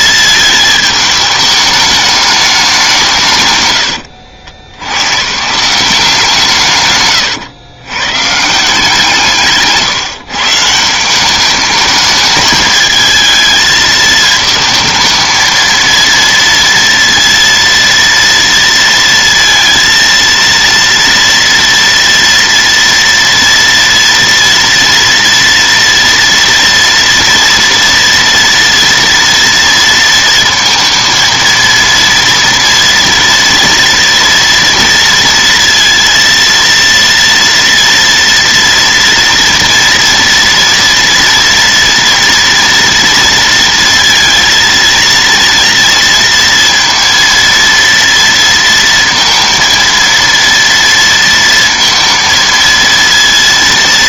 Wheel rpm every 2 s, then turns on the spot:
220, 200, 90, 140, 160, 160, 220, 220, 230, 230, 230, 230, 230, 230, 230, 230, 230, 230, 230, 230, 230, 230, 230, 230, 230, 230, 230.
none